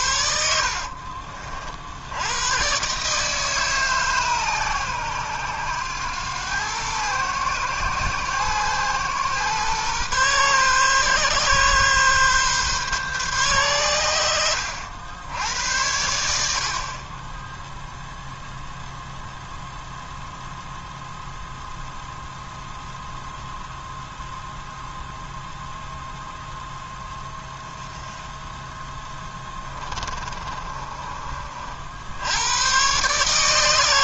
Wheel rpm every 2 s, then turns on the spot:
50, 140, 110, 120, 120, 130, 140, 80, 30, 0, 0, 0, 0, 10, 20, 30, 110.
0-2 28-32